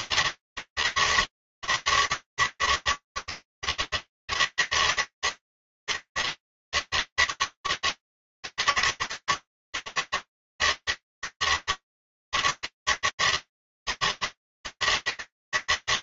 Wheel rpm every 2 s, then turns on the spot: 160, 140, 160, 150, 160, 150, 160, 160.
none